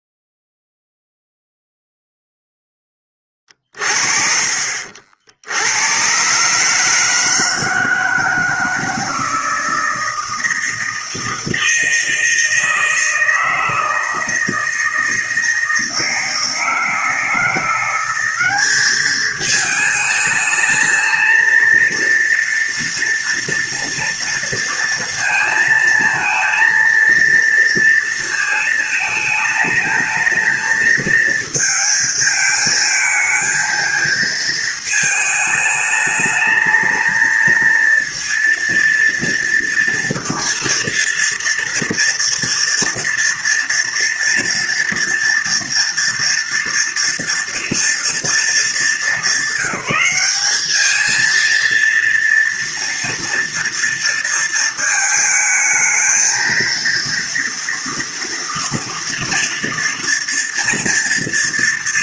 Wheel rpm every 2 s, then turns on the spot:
0, 0, 40, 130, 160, 160, 160, 160, 160, 190, 220, 230, 230, 220, 230, 220, 220, 220, 220, 230, 230, 230, 230, 230, 220, 200, 230, 230, 220, 230, 240.
none